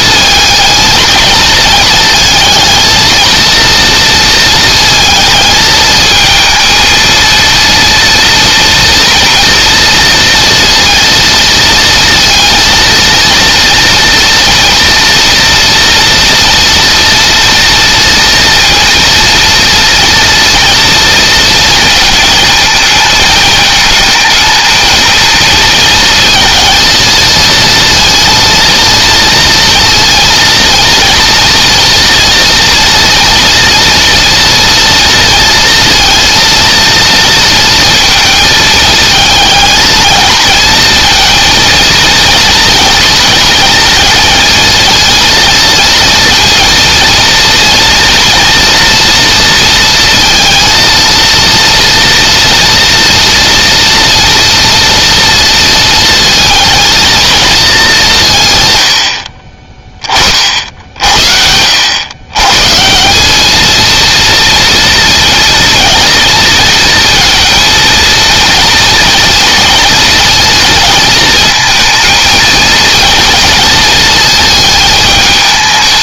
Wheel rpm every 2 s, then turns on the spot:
220, 230, 220, 230, 230, 230, 230, 230, 230, 230, 230, 220, 230, 230, 230, 230, 230, 230, 230, 220, 230, 230, 230, 230, 230, 230, 230, 230, 230, 70, 70, 170, 230, 230, 230, 230, 230, 210.
none